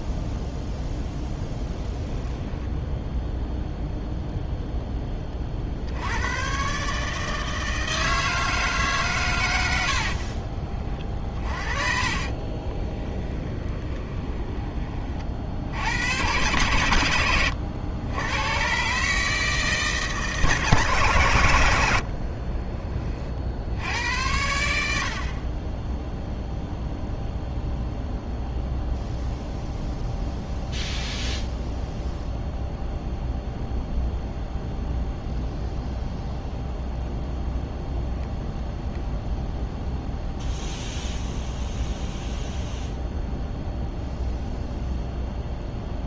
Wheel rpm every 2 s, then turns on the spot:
10, 0, 0, 140, 140, 30, 20, 30, 110, 140, 130, 40, 80, 0, 0, 0, 0, 0, 0, 0, 0, 0, 0.
12-14